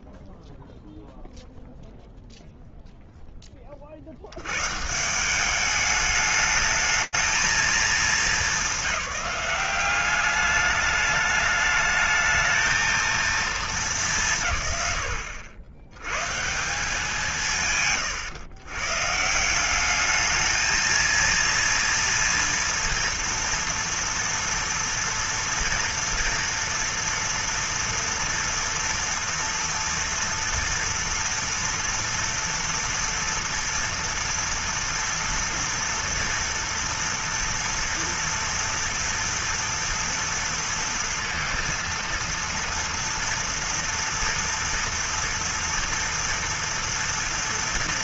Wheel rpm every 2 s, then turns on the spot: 0, 0, 180, 220, 190, 210, 220, 90, 170, 160, 230, 230, 230, 230, 230, 230, 230, 230, 230, 230, 230, 230, 230, 230.
none